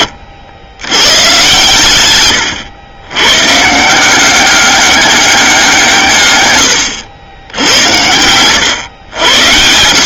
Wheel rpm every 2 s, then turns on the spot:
90, 110, 200, 110, 110.
none